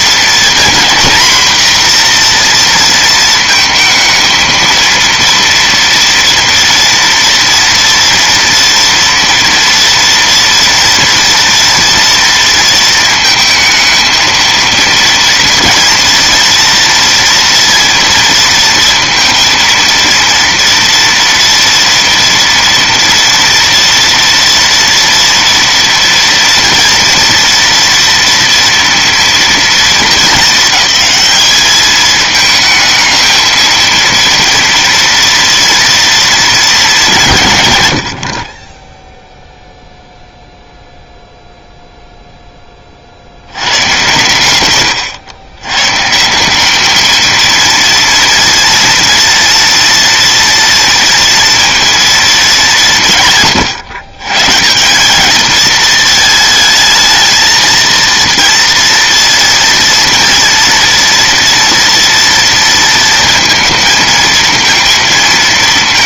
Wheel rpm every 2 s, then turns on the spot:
230, 240, 230, 230, 240, 230, 230, 230, 230, 230, 230, 240, 230, 230, 230, 210, 220, 230, 220, 20, 0, 10, 120, 200, 230, 230, 190, 160, 220, 230, 240, 230, 230.
none